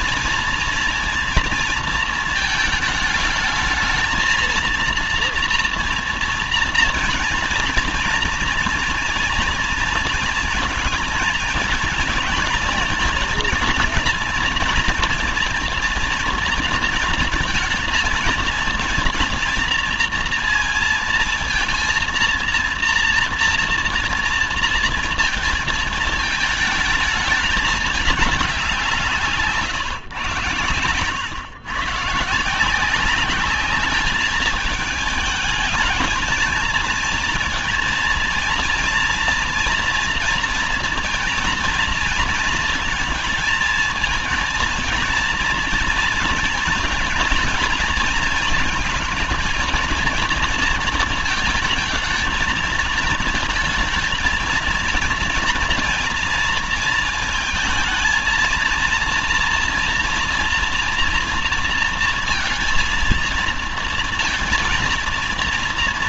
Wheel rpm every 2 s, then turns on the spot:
230, 220, 230, 230, 230, 230, 230, 230, 230, 230, 230, 230, 230, 220, 180, 120, 180, 210, 230, 230, 230, 220, 230, 230, 220, 220, 220, 230, 230, 230, 230, 230, 230.
none